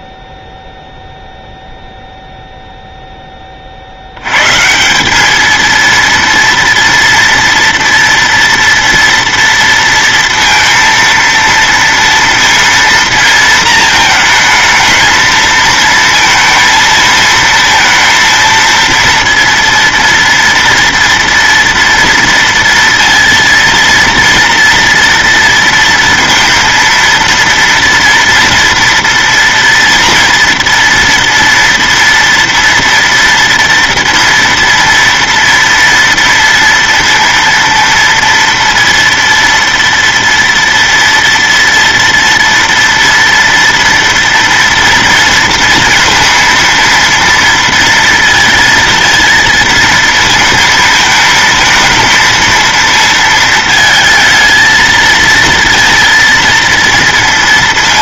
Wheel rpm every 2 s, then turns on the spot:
0, 0, 150, 230, 230, 230, 230, 220, 230, 230, 230, 230, 240, 230, 230, 230, 230, 230, 230, 230, 230, 230, 230, 230, 230, 220, 220, 220, 230.
none